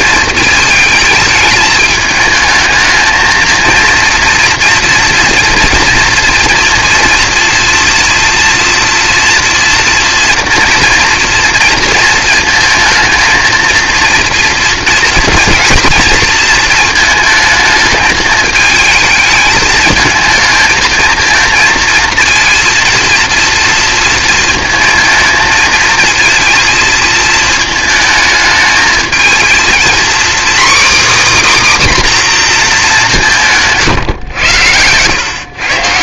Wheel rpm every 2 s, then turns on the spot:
220, 220, 230, 240, 230, 240, 230, 230, 230, 220, 230, 230, 220, 230, 220, 280, 240, 100.
none